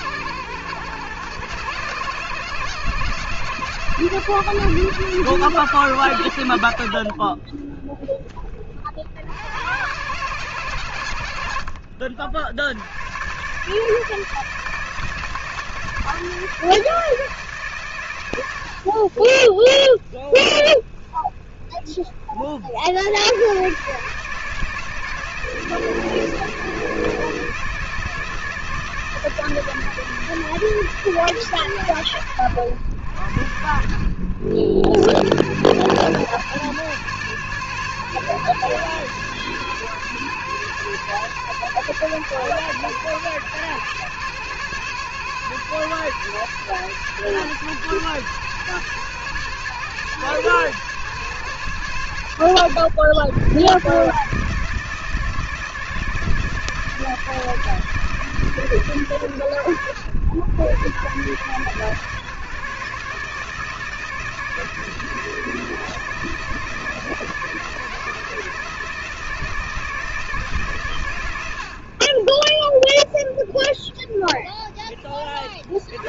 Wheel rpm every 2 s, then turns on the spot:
110, 130, 130, 40, 50, 100, 90, 160, 170, 60, 30, 70, 160, 160, 160, 160, 100, 80, 130, 130, 140, 130, 130, 130, 140, 140, 110, 160, 160, 130, 130, 150, 160, 160, 160, 140, 30, 30.
none